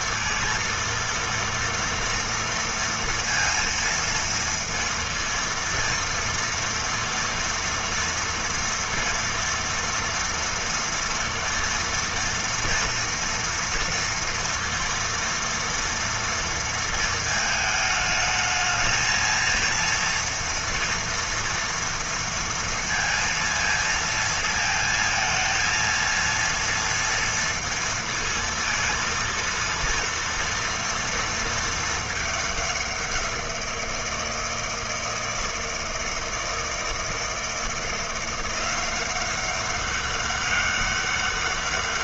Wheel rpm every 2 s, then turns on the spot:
230, 230, 230, 230, 230, 230, 240, 230, 230, 220, 230, 230, 230, 230, 230, 230, 200, 160, 160, 180, 200.
none